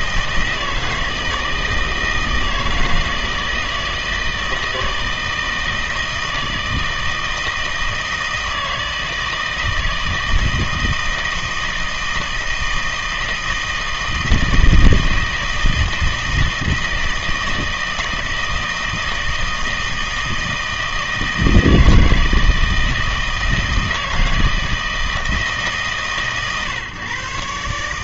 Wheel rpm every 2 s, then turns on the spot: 160, 160, 160, 160, 160, 160, 160, 160, 160, 160, 160, 160, 160, 130.
none